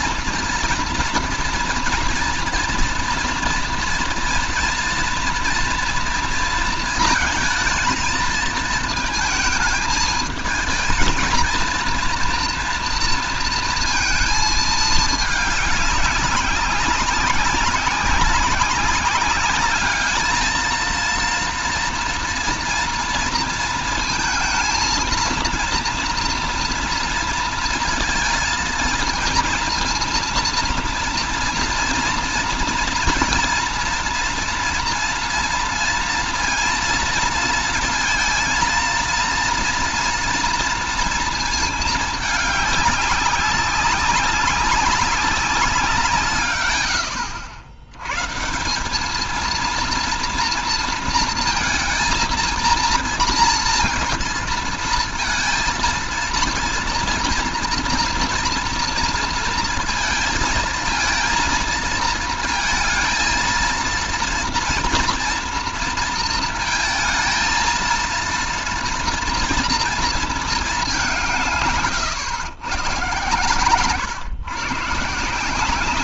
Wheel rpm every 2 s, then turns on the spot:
230, 230, 230, 230, 220, 230, 230, 220, 190, 200, 230, 230, 230, 230, 230, 230, 230, 230, 230, 230, 230, 200, 190, 110, 190, 230, 230, 230, 230, 230, 230, 230, 230, 230, 230, 200, 120, 140.
none